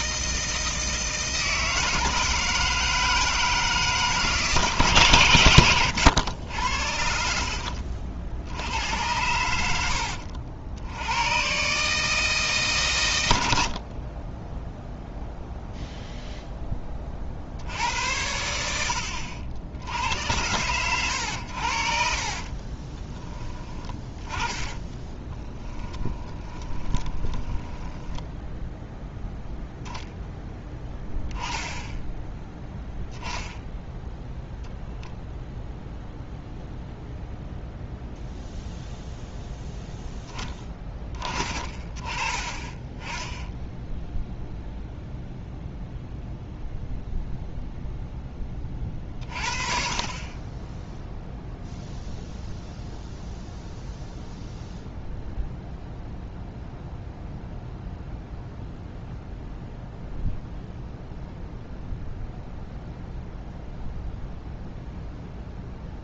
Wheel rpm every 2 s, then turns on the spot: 160, 160, 150, 80, 80, 80, 140, 10, 10, 80, 100, 20, 20, 20, 0, 10, 10, 0, 0, 0, 10, 10, 0, 0, 30, 10, 0, 0, 0, 0, 0, 0, 0.
22-28